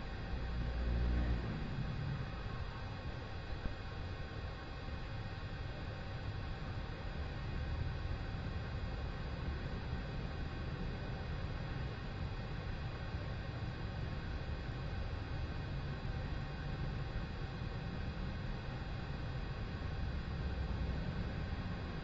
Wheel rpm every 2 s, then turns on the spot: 0, 0, 0, 0, 0, 0, 0, 0, 0, 0, 0.
none